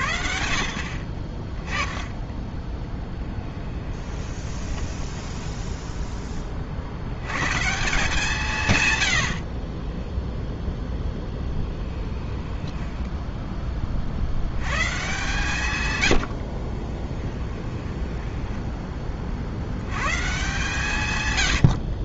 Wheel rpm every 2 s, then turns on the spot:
60, 10, 20, 50, 130, 0, 10, 120, 30, 10, 150.
4-6 12-14 16-18